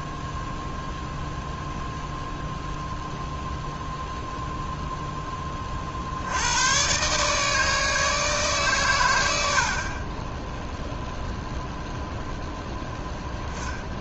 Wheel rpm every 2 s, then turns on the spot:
0, 0, 10, 130, 120, 0, 10.
none